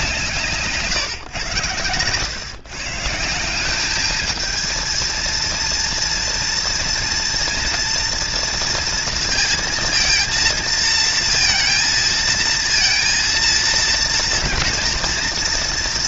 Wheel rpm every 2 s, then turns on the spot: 150, 150, 230, 230, 230, 230, 230, 230.
0-2